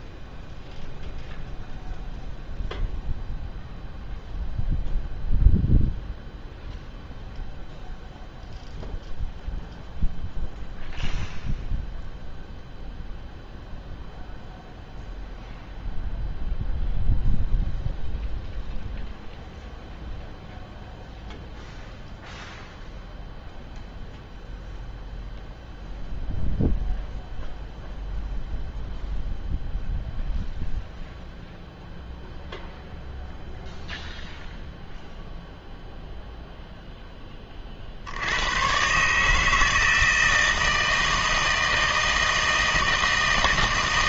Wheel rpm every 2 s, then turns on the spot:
0, 0, 0, 0, 0, 0, 0, 0, 0, 0, 0, 0, 0, 0, 0, 0, 0, 0, 0, 130, 160, 160.
none